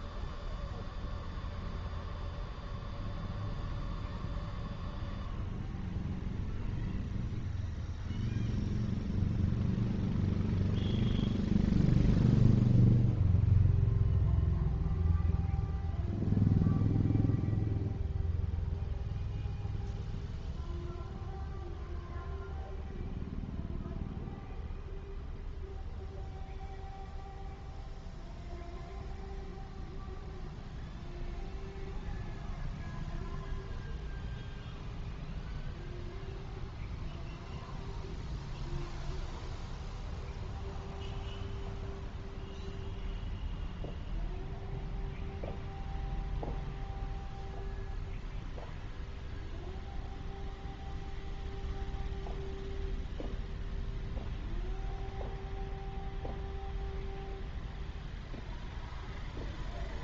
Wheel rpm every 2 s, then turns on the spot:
0, 0, 0, 0, 0, 0, 0, 0, 0, 0, 0, 0, 0, 0, 0, 0, 0, 0, 0, 0, 0, 0, 0, 0, 0, 0, 0, 0, 0, 0.
none